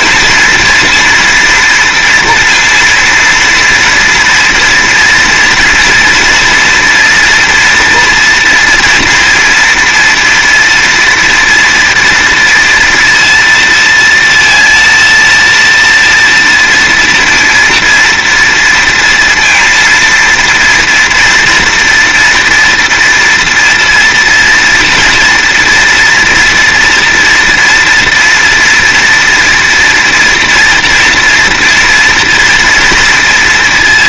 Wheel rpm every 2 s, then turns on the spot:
230, 230, 230, 230, 230, 230, 230, 230, 230, 230, 230, 230, 230, 240, 230, 230, 230.
none